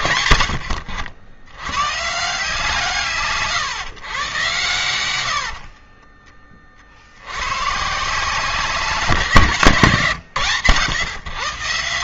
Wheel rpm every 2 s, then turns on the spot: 70, 150, 80, 70, 160, 110.
4-6